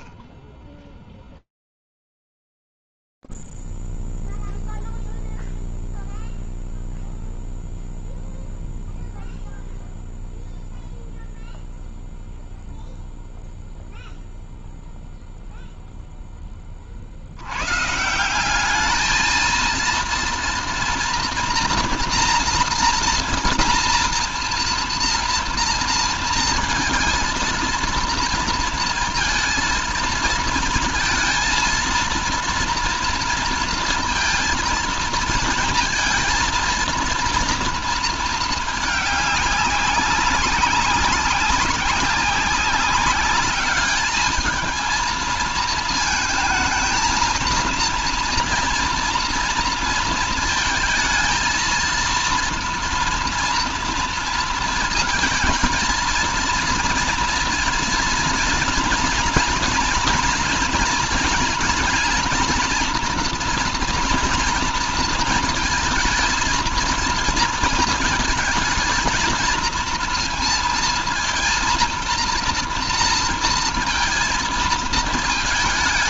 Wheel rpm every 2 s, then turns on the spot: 0, 0, 0, 0, 0, 0, 0, 0, 0, 160, 230, 240, 230, 230, 230, 230, 230, 230, 230, 220, 200, 190, 220, 220, 230, 220, 230, 230, 230, 230, 230, 230, 230, 230, 230, 230, 230, 230.
none